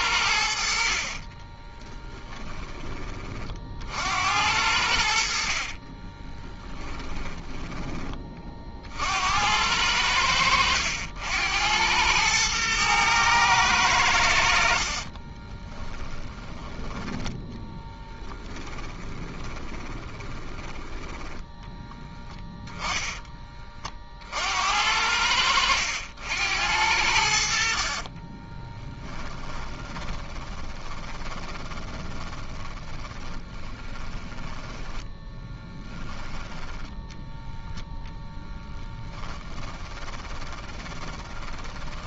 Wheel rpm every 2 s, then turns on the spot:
60, 10, 80, 30, 40, 80, 110, 70, 10, 10, 20, 10, 70, 80, 20, 20, 30, 20, 20, 10, 20.
6-8 18-22 28-36 38-42